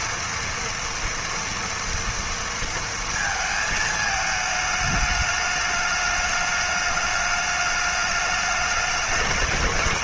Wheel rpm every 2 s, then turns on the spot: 230, 230, 210, 210, 220.
none